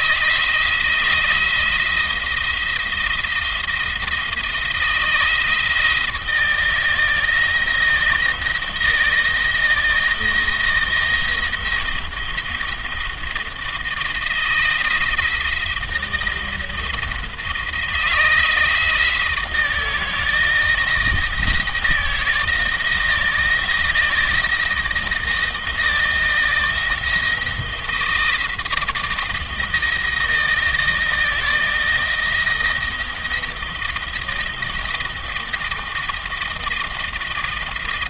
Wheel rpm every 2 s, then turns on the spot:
170, 170, 160, 160, 160, 170, 170, 170, 170, 160, 160, 160, 160, 170, 160, 160, 170, 170, 170.
none